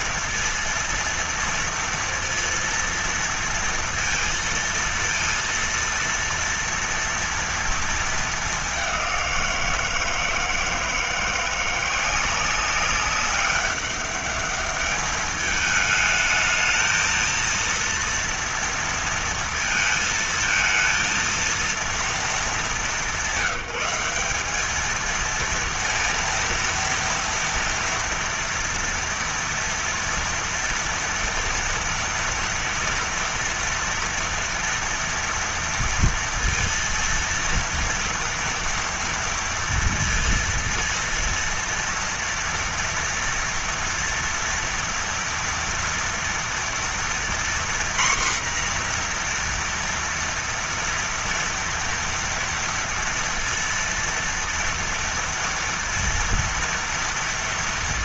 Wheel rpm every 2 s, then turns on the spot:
230, 230, 230, 230, 210, 160, 190, 200, 220, 230, 220, 210, 210, 230, 230, 230, 230, 230, 230, 230, 230, 230, 230, 230, 250, 230, 230, 230, 230.
none